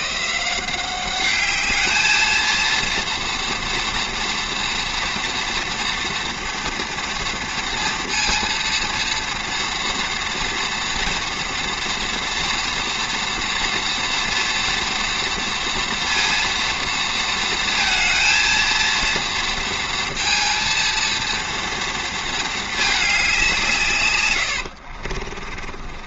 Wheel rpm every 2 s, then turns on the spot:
170, 230, 230, 230, 230, 240, 230, 230, 230, 230, 230, 220, 90.
24-26